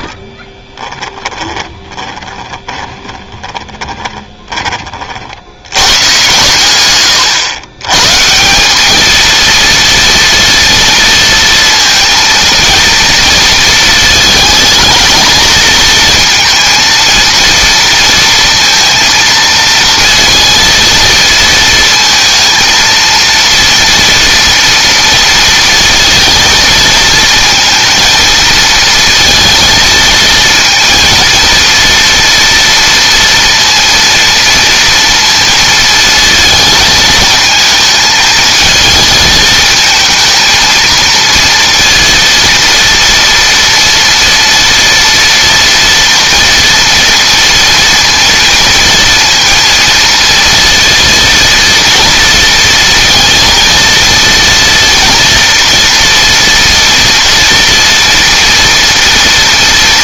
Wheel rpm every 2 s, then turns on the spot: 10, 20, 20, 120, 200, 230, 230, 220, 230, 230, 230, 230, 230, 230, 230, 230, 230, 230, 220, 220, 230, 230, 230, 230, 230, 230, 230, 230, 230, 230.
0-4